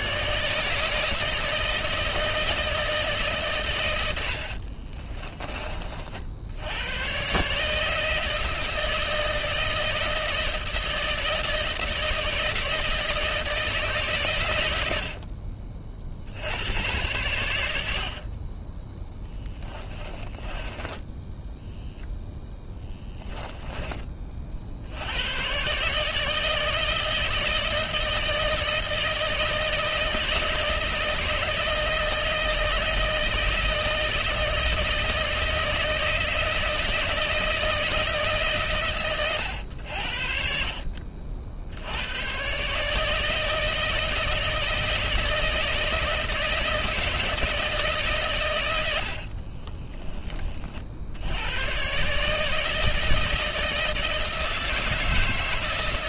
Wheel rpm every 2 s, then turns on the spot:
150, 160, 50, 90, 160, 160, 160, 90, 90, 10, 10, 10, 60, 160, 160, 160, 160, 160, 160, 130, 50, 140, 160, 160, 90, 50, 160, 160.
4-6 20-22